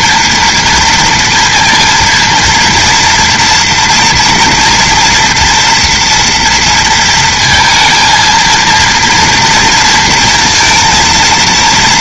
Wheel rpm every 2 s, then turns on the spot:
230, 230, 240, 230, 230, 230.
none